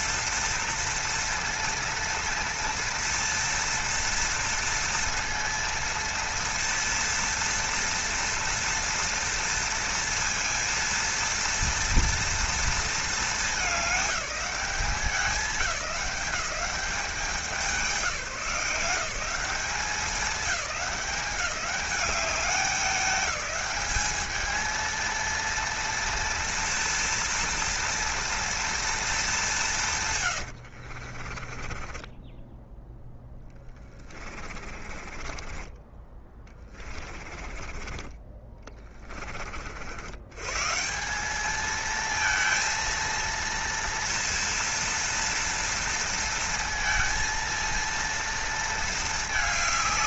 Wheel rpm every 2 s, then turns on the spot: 230, 230, 230, 230, 230, 230, 230, 200, 190, 180, 190, 200, 220, 230, 230, 80, 10, 30, 20, 30, 150, 230, 230, 230, 220.
30-32 34-40